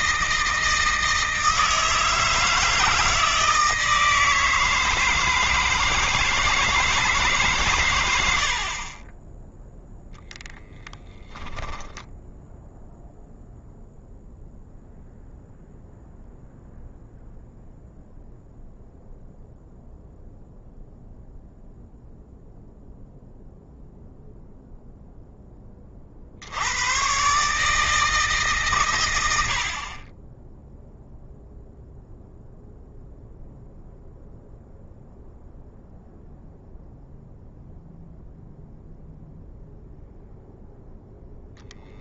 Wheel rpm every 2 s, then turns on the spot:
160, 160, 160, 160, 20, 10, 0, 0, 0, 0, 0, 0, 0, 120, 100, 0, 0, 0, 0, 0, 0.
10-12